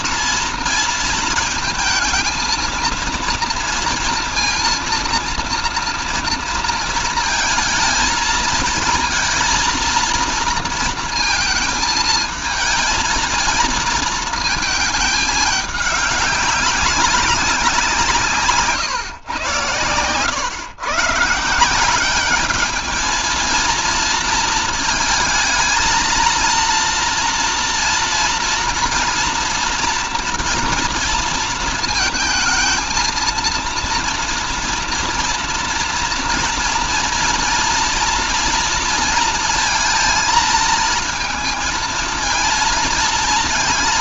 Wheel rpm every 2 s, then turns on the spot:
230, 230, 230, 230, 230, 230, 220, 220, 190, 140, 130, 220, 230, 230, 230, 230, 230, 230, 230, 230, 220, 230.
none